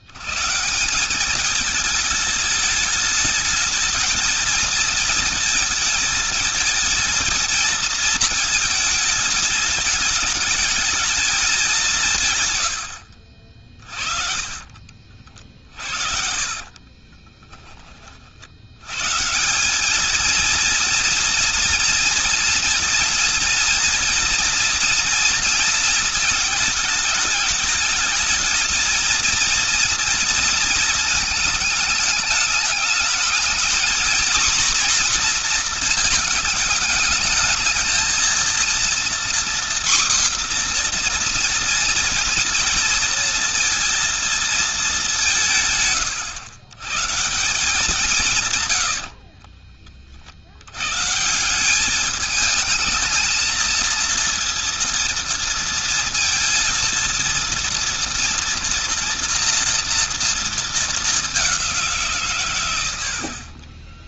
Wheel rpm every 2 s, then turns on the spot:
180, 210, 220, 220, 220, 220, 100, 40, 30, 120, 230, 230, 230, 220, 220, 220, 220, 240, 220, 240, 240, 230, 200, 140, 80, 140, 220, 230, 230, 230, 210, 100.
16-18 48-50 62-64